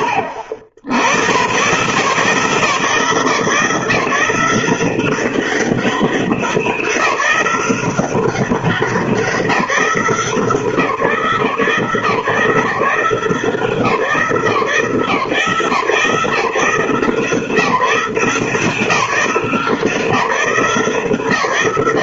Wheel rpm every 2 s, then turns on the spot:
80, 150, 180, 180, 190, 170, 170, 160, 150, 170, 170.
none